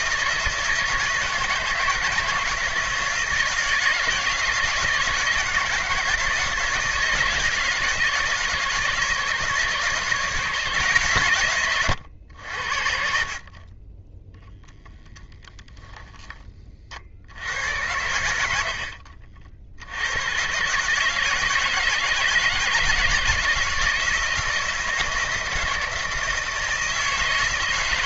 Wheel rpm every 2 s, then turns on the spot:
160, 160, 170, 170, 150, 160, 70, 0, 30, 80, 130, 160, 160, 160.
none